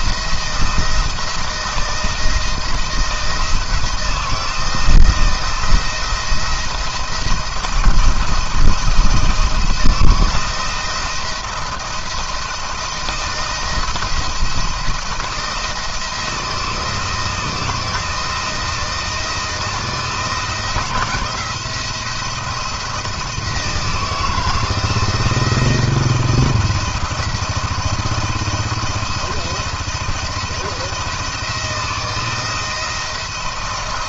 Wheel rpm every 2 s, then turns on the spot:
170, 160, 160, 170, 160, 170, 160, 170, 170, 170, 170, 170, 160, 170, 170, 170, 160.
none